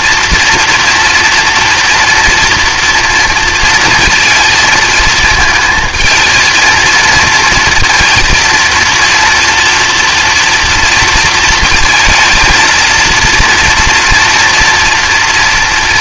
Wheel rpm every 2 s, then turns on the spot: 230, 230, 220, 230, 230, 230, 230, 230.
none